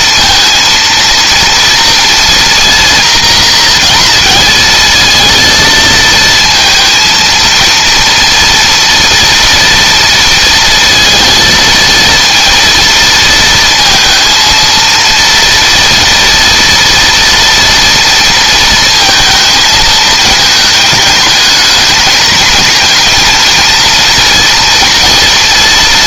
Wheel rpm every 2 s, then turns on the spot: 230, 240, 230, 230, 230, 230, 230, 230, 230, 230, 210, 220, 230.
none